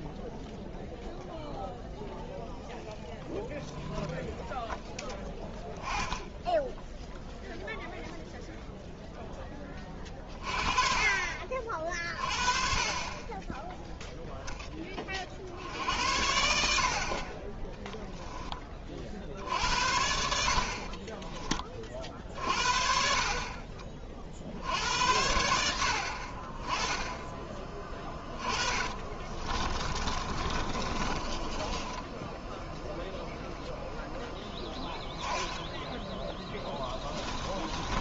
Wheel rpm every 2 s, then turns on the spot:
0, 0, 0, 0, 0, 30, 40, 10, 70, 20, 50, 50, 60, 30, 20, 30, 0, 10, 10.
28-32 36-38